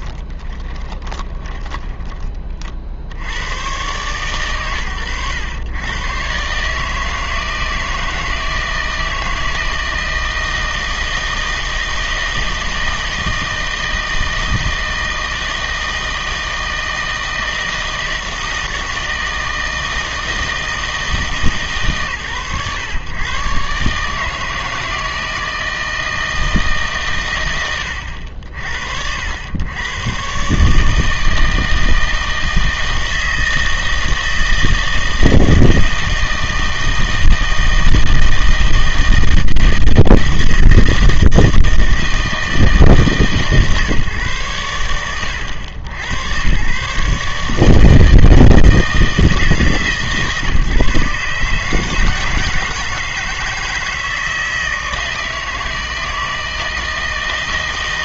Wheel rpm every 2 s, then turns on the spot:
20, 50, 100, 150, 160, 160, 160, 160, 160, 160, 160, 120, 160, 140, 60, 150, 160, 160, 160, 160, 160, 160, 110, 130, 160, 150, 160, 160, 160.
0-2